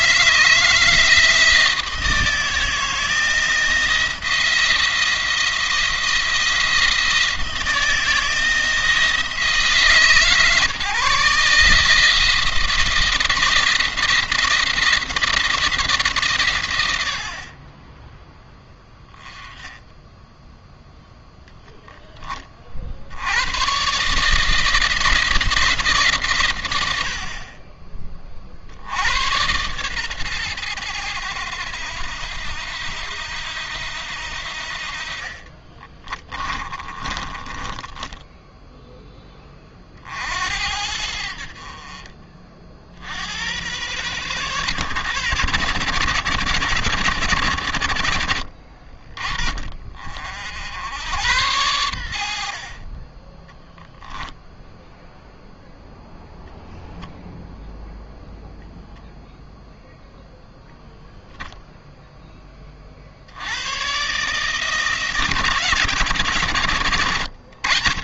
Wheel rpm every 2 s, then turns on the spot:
160, 160, 170, 160, 160, 150, 160, 170, 110, 20, 0, 40, 160, 100, 60, 110, 90, 60, 30, 10, 70, 50, 100, 80, 40, 80, 50, 0, 0, 0, 0, 20, 150, 110.
36-38